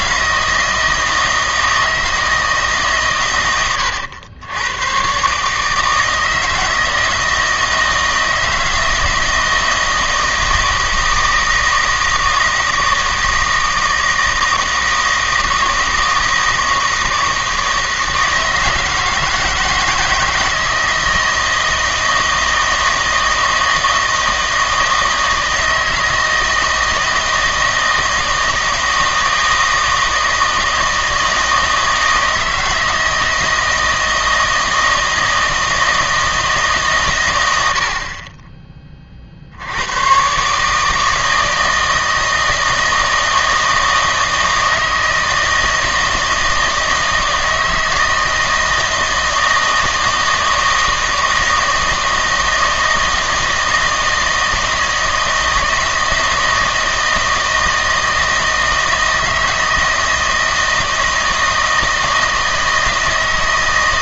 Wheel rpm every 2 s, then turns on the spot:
160, 150, 100, 160, 160, 160, 160, 160, 160, 160, 160, 160, 160, 160, 160, 160, 160, 160, 150, 20, 150, 160, 160, 160, 160, 160, 160, 160, 160, 160, 160, 160.
none